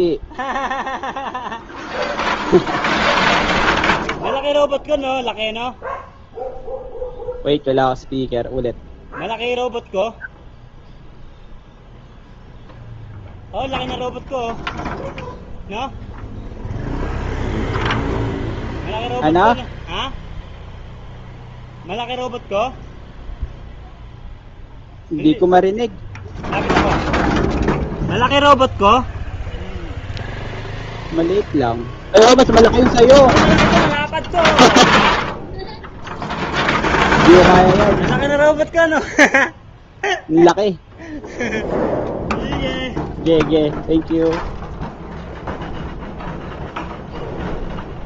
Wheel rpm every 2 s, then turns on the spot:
0, 0, 0, 0, 0, 0, 0, 0, 0, 0, 0, 0, 0, 0, 0, 0, 0, 0, 0, 0, 0, 0, 0, 0.
none